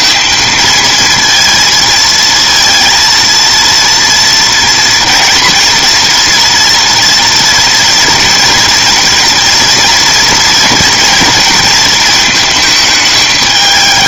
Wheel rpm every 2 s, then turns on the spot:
230, 230, 240, 230, 230, 230, 220.
none